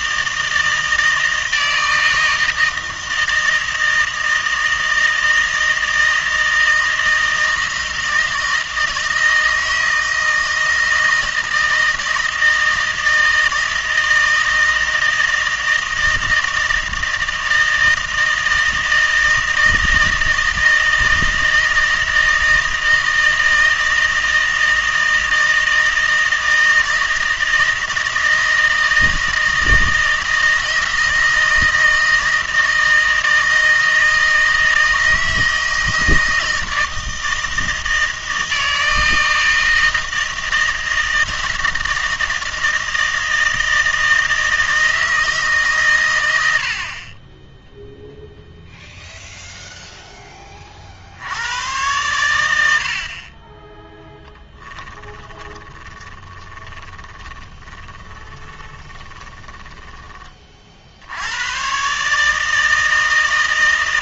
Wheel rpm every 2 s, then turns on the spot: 160, 160, 160, 160, 160, 160, 160, 160, 160, 160, 160, 160, 160, 160, 160, 160, 160, 160, 160, 160, 160, 160, 160, 60, 0, 30, 80, 20, 20, 20, 60, 160.
54-60